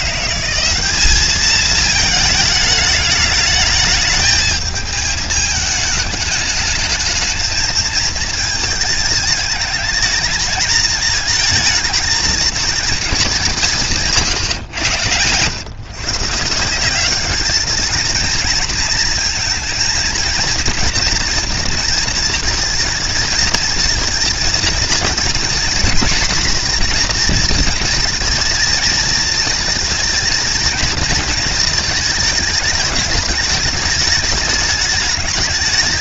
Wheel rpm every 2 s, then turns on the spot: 200, 210, 220, 220, 220, 220, 220, 120, 190, 230, 230, 230, 230, 240, 230, 220, 210, 210.
14-16